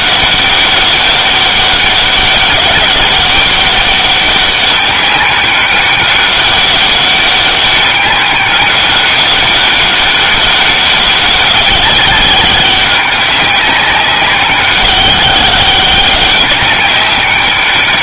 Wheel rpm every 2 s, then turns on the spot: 200, 190, 200, 200, 200, 200, 200, 200, 200.
none